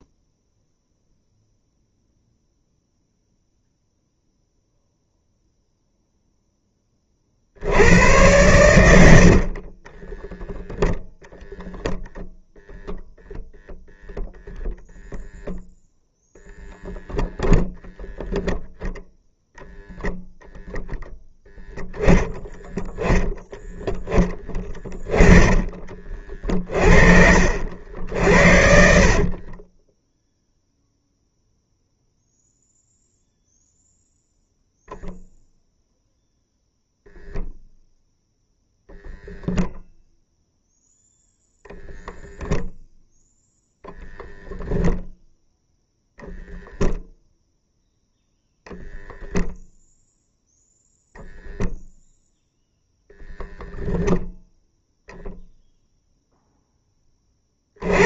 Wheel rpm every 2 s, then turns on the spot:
0, 0, 0, 10, 100, 0, 0, 0, 0, 0, 0, 10, 10, 30, 60, 0, 0, 0, 0, 0, 0, 0, 0, 0, 0, 0, 0, 0, 0.
24-26 28-30